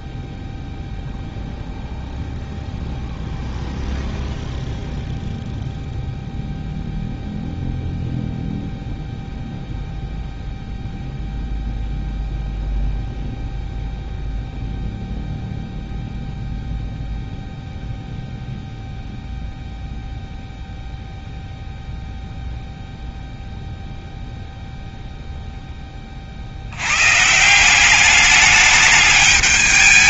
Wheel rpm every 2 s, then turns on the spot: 0, 0, 0, 0, 0, 0, 0, 0, 0, 0, 0, 0, 0, 100, 210.
none